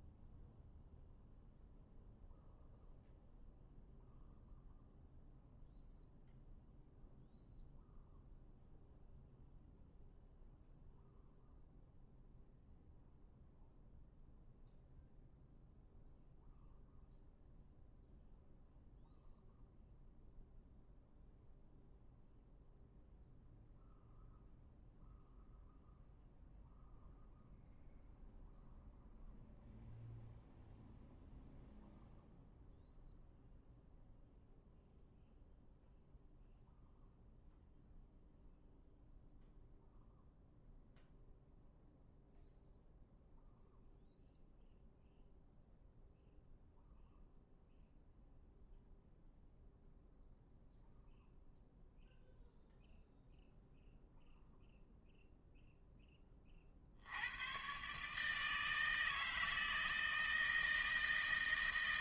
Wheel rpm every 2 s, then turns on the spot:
0, 0, 0, 0, 0, 0, 0, 0, 0, 0, 0, 0, 0, 0, 0, 0, 0, 0, 0, 0, 0, 0, 0, 0, 0, 0, 0, 0, 40, 160, 160.
none